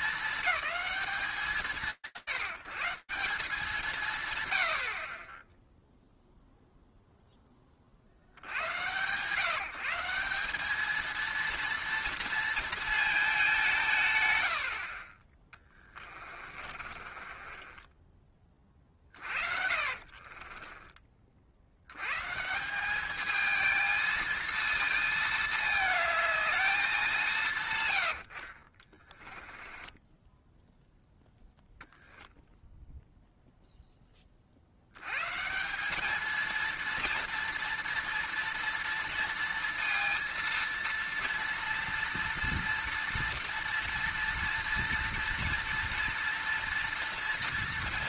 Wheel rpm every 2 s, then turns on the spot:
210, 150, 140, 0, 100, 210, 230, 70, 40, 40, 30, 200, 220, 190, 20, 0, 0, 120, 230, 230, 230, 230, 230, 230.
16-20 28-30